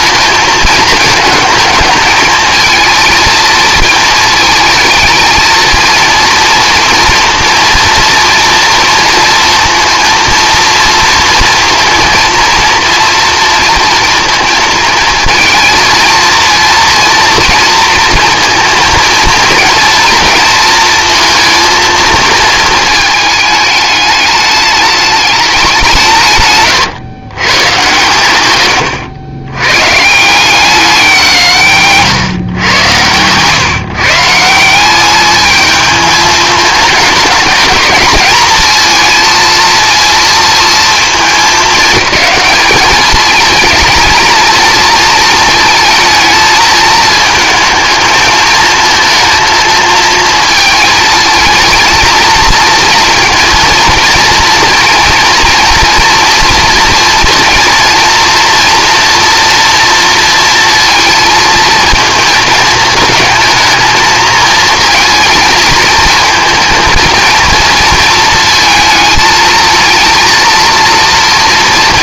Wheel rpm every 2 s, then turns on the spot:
220, 220, 220, 230, 230, 230, 230, 230, 230, 230, 230, 220, 210, 140, 110, 180, 110, 190, 220, 230, 220, 210, 220, 220, 220, 230, 230, 230, 240, 240, 230, 220, 230, 230, 220, 230.
none